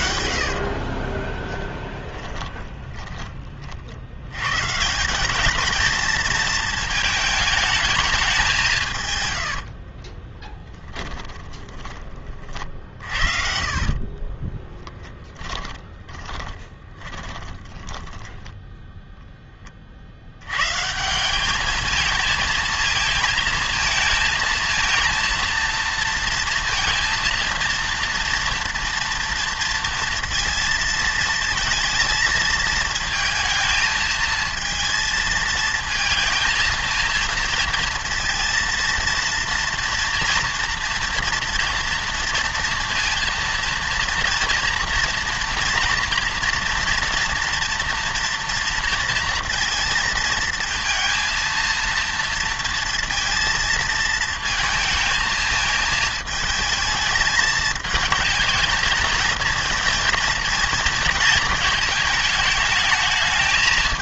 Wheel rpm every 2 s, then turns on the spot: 60, 20, 130, 220, 170, 10, 50, 20, 20, 10, 120, 230, 230, 230, 230, 230, 220, 230, 220, 230, 240, 230, 230, 230, 230, 230, 230, 220, 220, 220, 230, 220.
0-4 10-18